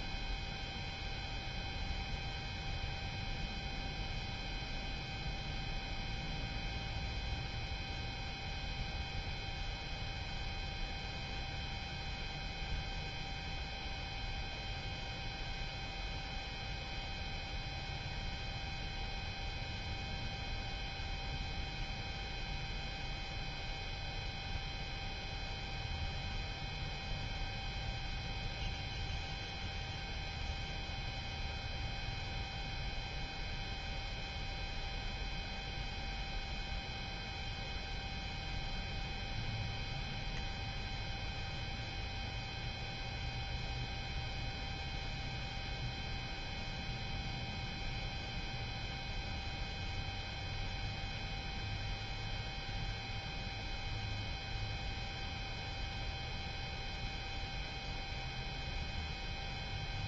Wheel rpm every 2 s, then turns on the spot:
0, 0, 0, 0, 0, 0, 0, 0, 0, 0, 0, 0, 0, 0, 0, 0, 0, 0, 0, 0, 0, 0, 0, 0, 0, 0, 0, 0, 0, 0.
none